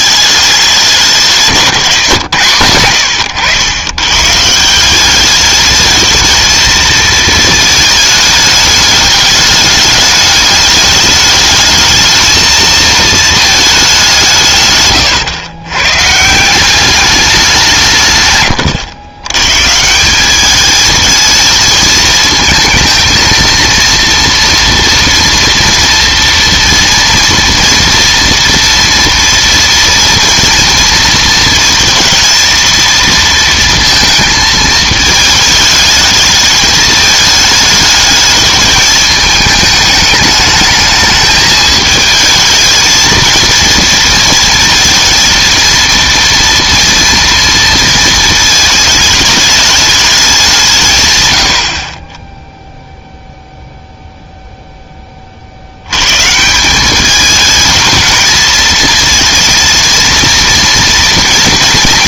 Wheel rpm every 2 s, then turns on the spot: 200, 120, 170, 230, 210, 210, 220, 150, 180, 120, 210, 220, 230, 230, 230, 230, 230, 220, 220, 210, 220, 220, 230, 230, 220, 180, 0, 0, 180, 230, 230.
none